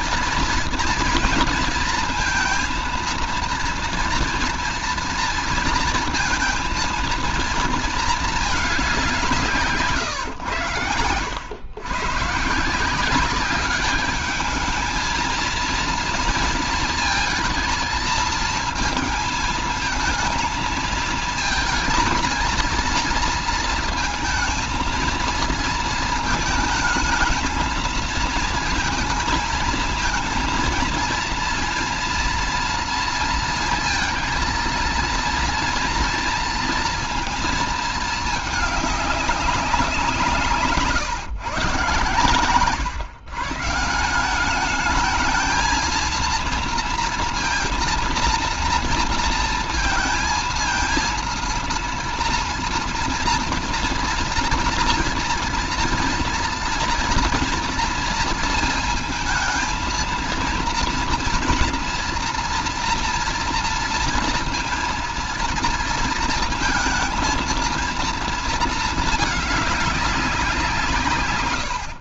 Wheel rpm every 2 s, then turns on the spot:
230, 230, 230, 220, 210, 110, 150, 210, 230, 220, 230, 230, 220, 220, 220, 220, 230, 230, 230, 210, 150, 130, 190, 230, 230, 230, 230, 230, 230, 230, 230, 230, 230, 230, 230, 180.
none